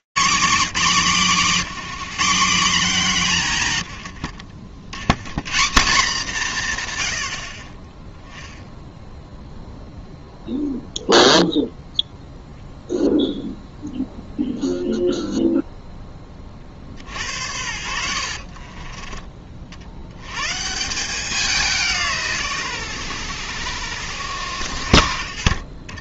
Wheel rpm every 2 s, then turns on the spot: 140, 190, 150, 180, 20, 0, 0, 0, 40, 40, 140, 120, 80.
18-20